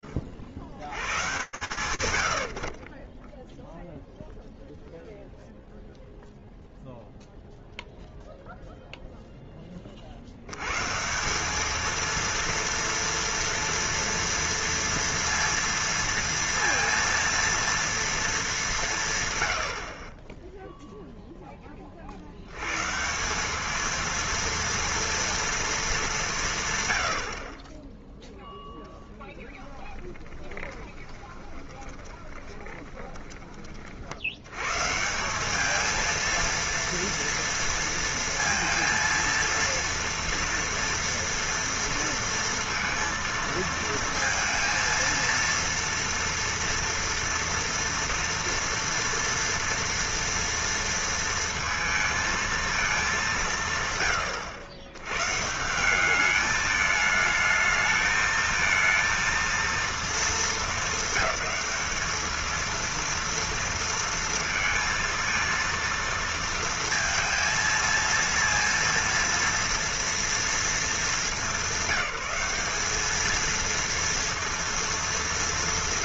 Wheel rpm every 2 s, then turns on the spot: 60, 0, 0, 0, 10, 200, 230, 230, 230, 100, 10, 200, 230, 40, 10, 20, 20, 200, 230, 230, 230, 230, 230, 230, 230, 230, 200, 120, 220, 230, 220, 230, 230, 230, 230, 210, 220, 230.
30-32